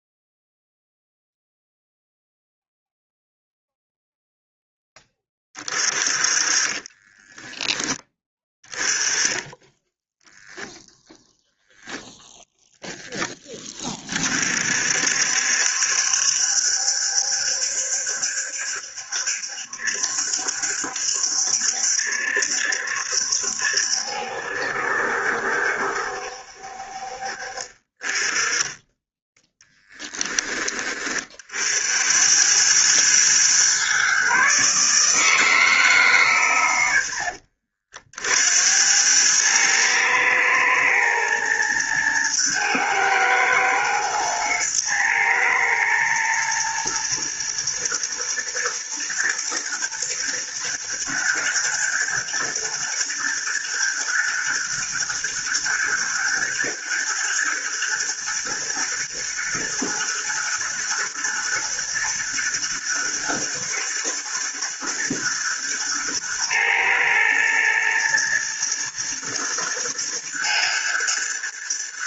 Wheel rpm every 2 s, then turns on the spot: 0, 0, 20, 20, 10, 0, 10, 60, 70, 70, 70, 70, 70, 60, 10, 30, 110, 150, 90, 90, 110, 110, 120, 110, 110, 110, 120, 110, 110, 110, 120, 110, 110, 110, 120, 110.
6-8